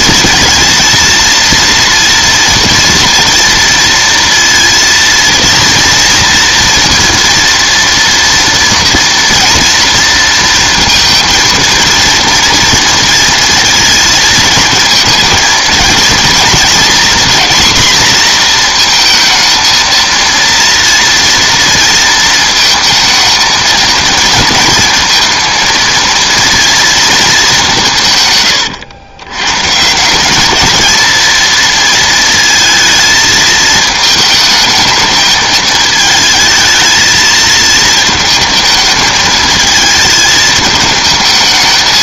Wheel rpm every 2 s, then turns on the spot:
230, 230, 230, 230, 240, 230, 230, 220, 230, 230, 230, 220, 230, 230, 110, 210, 220, 220, 220, 220, 220.
none